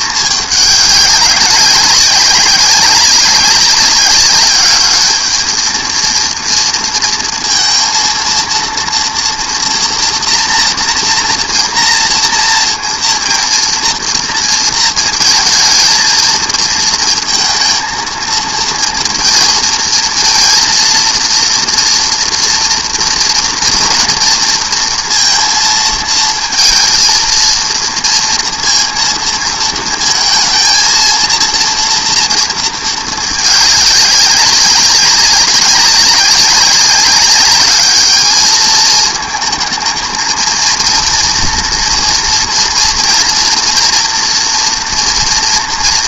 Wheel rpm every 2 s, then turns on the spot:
210, 190, 200, 230, 230, 230, 230, 230, 220, 230, 230, 230, 230, 220, 230, 220, 230, 200, 190, 210, 230, 230, 230.
none